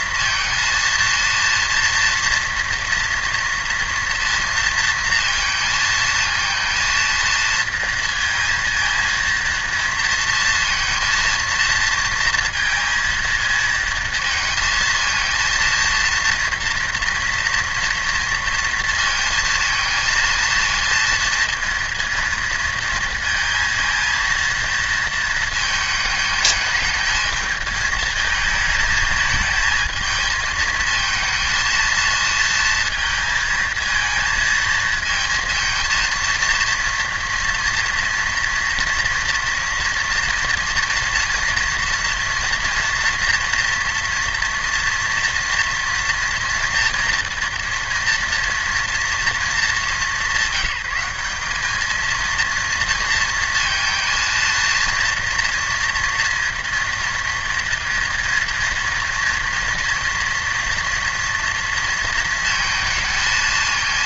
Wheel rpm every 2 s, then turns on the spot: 230, 230, 230, 230, 230, 230, 230, 230, 230, 230, 230, 230, 230, 220, 220, 220, 230, 230, 230, 230, 230, 230, 230, 230, 230, 180, 230, 230, 230, 230, 230, 230.
none